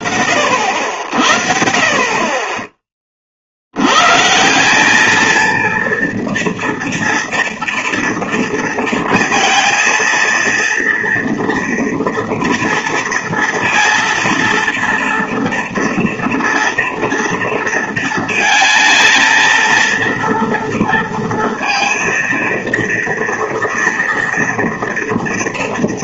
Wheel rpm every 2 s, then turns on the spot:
60, 50, 220, 240, 230, 230, 230, 230, 230, 230, 230, 230, 230.
none